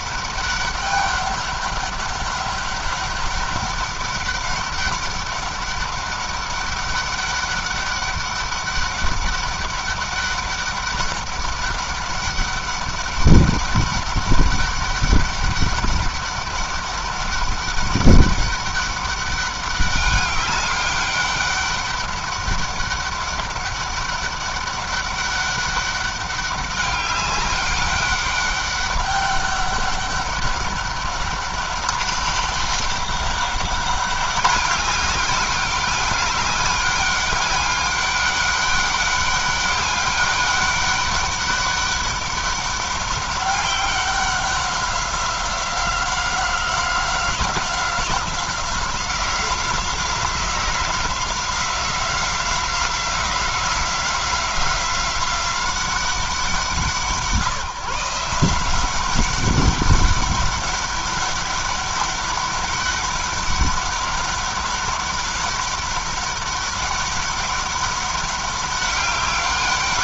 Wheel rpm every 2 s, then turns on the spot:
200, 200, 200, 200, 200, 200, 200, 200, 200, 200, 200, 200, 200, 200, 200, 200, 200, 200, 200, 200, 200, 200, 190, 180, 180, 180, 180, 190, 170, 180, 200, 200, 200, 190, 200.
none